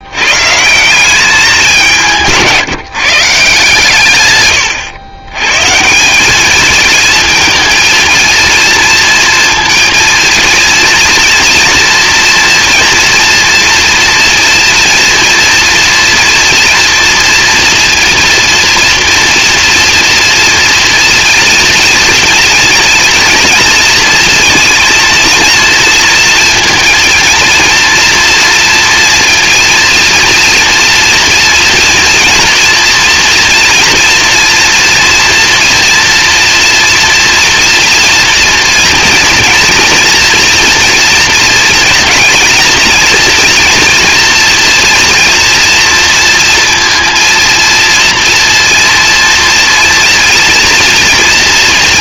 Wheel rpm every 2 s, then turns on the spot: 170, 160, 110, 230, 230, 230, 230, 230, 230, 240, 230, 240, 230, 230, 230, 240, 230, 230, 230, 240, 230, 220, 230, 230, 230, 230.
none